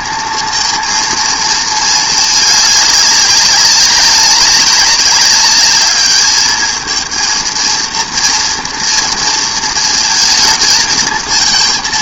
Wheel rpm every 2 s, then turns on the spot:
220, 210, 200, 220, 230, 220.
none